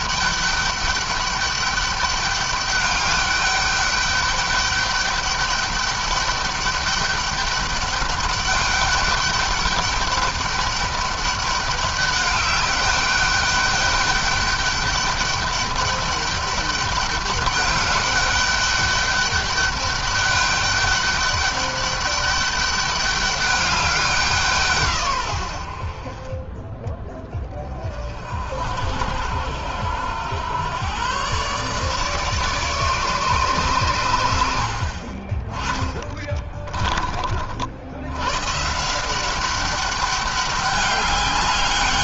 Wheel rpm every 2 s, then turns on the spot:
200, 200, 200, 200, 200, 200, 200, 200, 200, 200, 210, 200, 150, 20, 70, 120, 150, 60, 30, 150, 200.
36-38